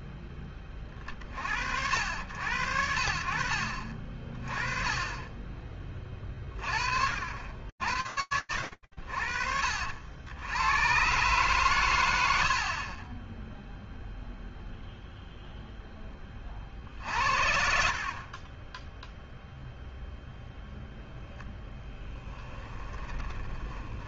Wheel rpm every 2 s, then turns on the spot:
20, 80, 30, 50, 70, 100, 60, 0, 80, 10, 0, 20.
22-24